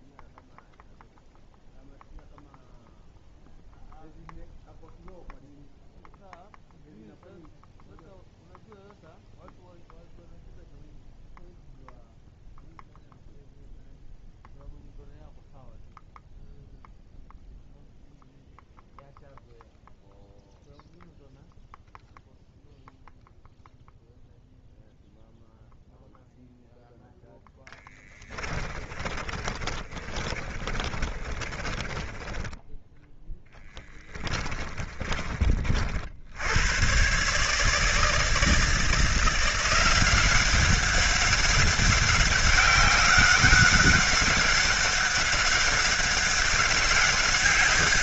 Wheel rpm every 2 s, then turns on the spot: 0, 0, 0, 0, 0, 0, 0, 0, 0, 0, 0, 0, 0, 0, 20, 40, 20, 20, 50, 160, 180, 190, 200, 190.
28-36